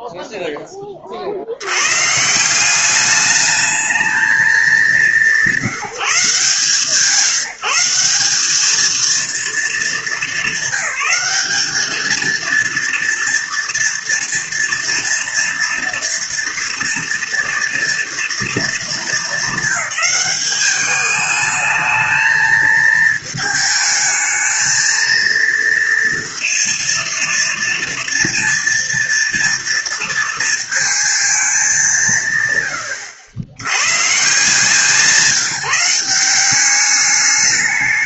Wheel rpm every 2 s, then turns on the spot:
10, 170, 190, 150, 200, 200, 230, 230, 230, 220, 200, 220, 220, 230, 230, 230, 120, 180, 190.
none